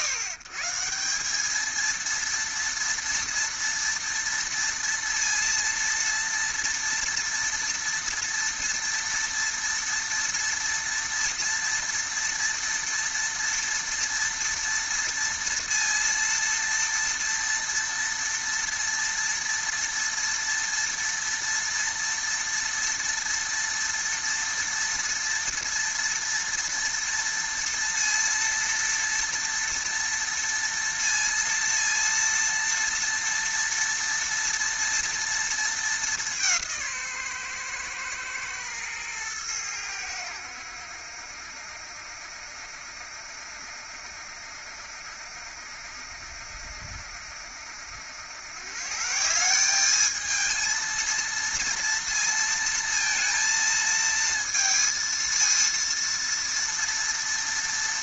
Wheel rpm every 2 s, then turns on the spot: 140, 230, 230, 230, 230, 230, 230, 230, 230, 230, 230, 240, 230, 230, 230, 230, 230, 230, 170, 120, 80, 70, 70, 70, 130, 220, 230, 230, 230.
none